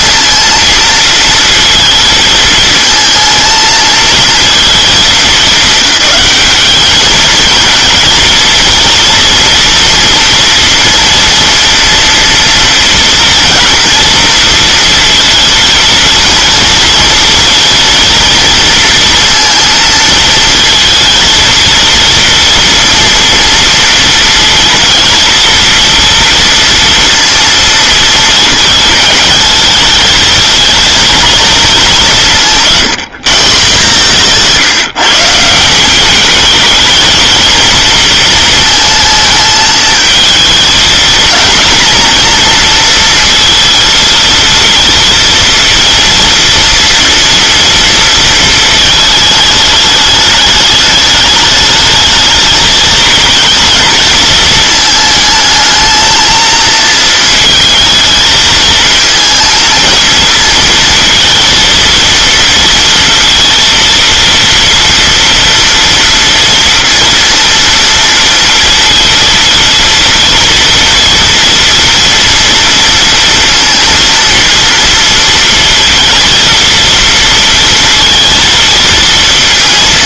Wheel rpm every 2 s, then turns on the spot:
230, 220, 230, 210, 230, 230, 230, 230, 230, 230, 220, 240, 230, 230, 220, 220, 180, 160, 220, 230, 220, 230, 230, 230, 220, 210, 220, 220, 230, 220, 230, 230, 230, 230, 230, 230, 230, 230, 230, 230.
none